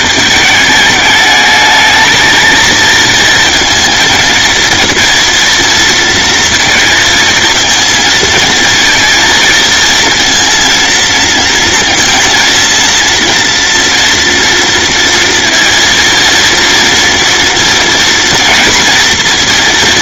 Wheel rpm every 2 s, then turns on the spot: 210, 230, 230, 230, 230, 230, 230, 230, 230, 240.
none